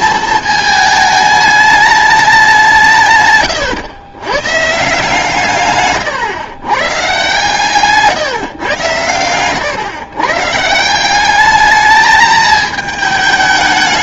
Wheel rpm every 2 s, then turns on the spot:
220, 180, 130, 130, 120, 150, 220.
none